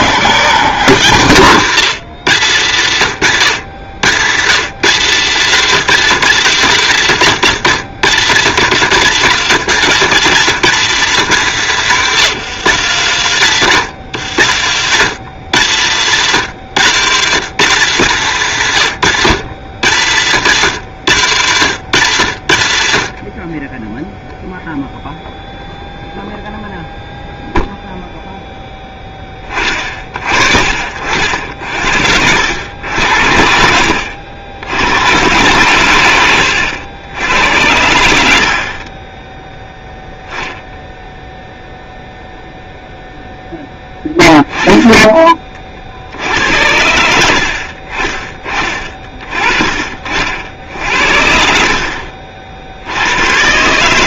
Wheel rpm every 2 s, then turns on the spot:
150, 130, 150, 160, 140, 170, 160, 130, 150, 130, 130, 70, 0, 0, 10, 50, 90, 90, 90, 40, 0, 0, 10, 80, 30, 70, 60.
50-52